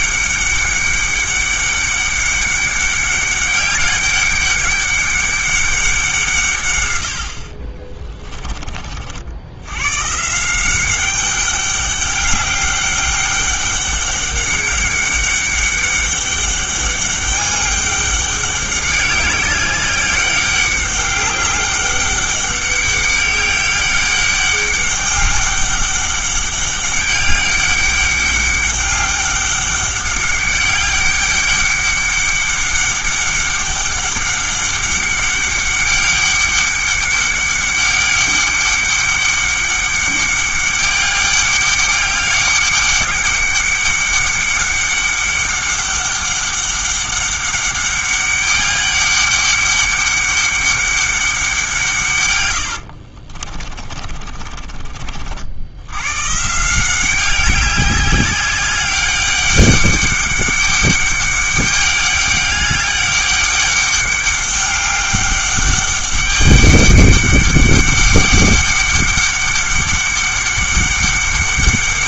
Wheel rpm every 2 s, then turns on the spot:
200, 200, 200, 110, 40, 180, 200, 200, 200, 200, 200, 200, 200, 200, 200, 200, 200, 200, 200, 200, 200, 200, 200, 200, 200, 200, 90, 40, 170, 200, 200, 200, 200, 200, 200, 200.
52-56